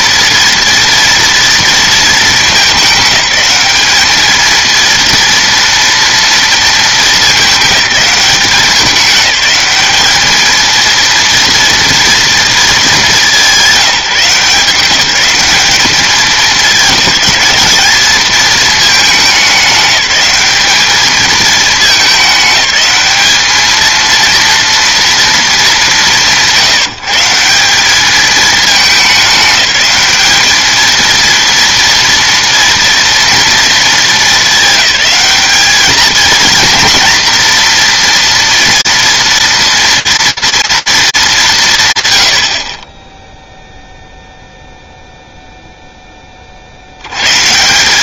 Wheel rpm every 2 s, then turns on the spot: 230, 200, 230, 230, 200, 220, 220, 180, 210, 220, 210, 210, 230, 150, 210, 220, 230, 210, 230, 230, 230, 30, 0, 60.
none